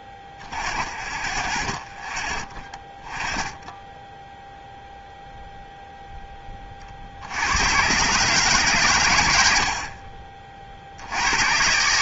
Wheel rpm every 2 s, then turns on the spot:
30, 30, 0, 30, 140, 50.
none